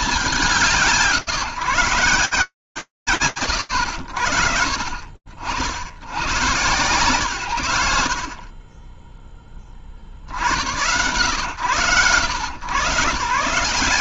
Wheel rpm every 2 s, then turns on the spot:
190, 90, 90, 110, 40, 100, 130.
none